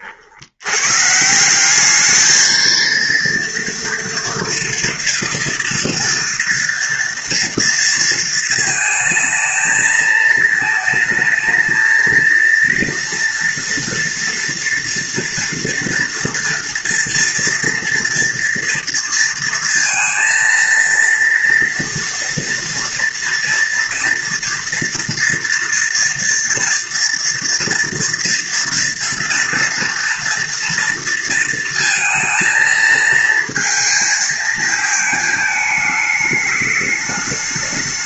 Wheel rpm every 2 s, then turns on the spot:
120, 230, 230, 230, 220, 220, 230, 230, 230, 230, 230, 230, 230, 230, 230, 230, 230, 220, 210.
none